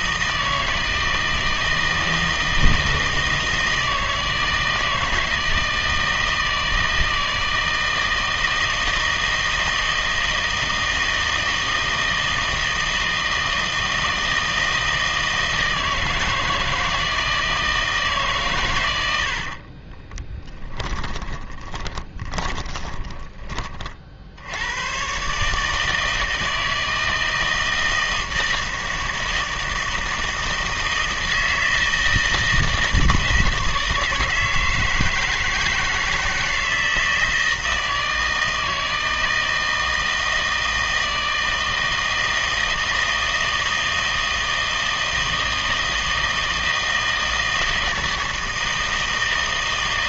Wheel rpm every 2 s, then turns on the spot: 160, 160, 160, 160, 160, 160, 160, 160, 160, 110, 10, 20, 90, 160, 160, 160, 160, 160, 160, 160, 160, 160, 160, 160, 160.
20-24